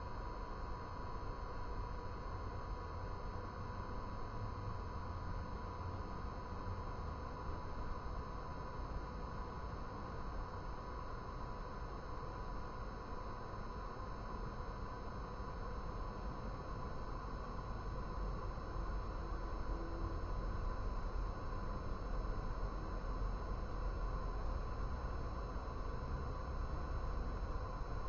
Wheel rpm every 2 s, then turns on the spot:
0, 0, 0, 0, 0, 0, 0, 0, 0, 0, 0, 0, 0, 0.
none